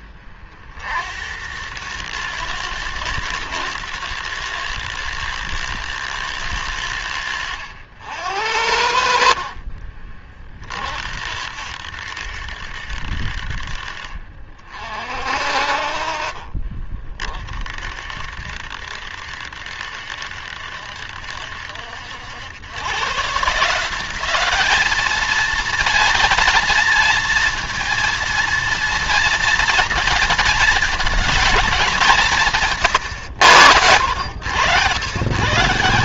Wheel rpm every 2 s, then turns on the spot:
50, 110, 110, 100, 70, 50, 70, 40, 40, 60, 70, 100, 210, 230, 230, 220, 150, 110.
32-34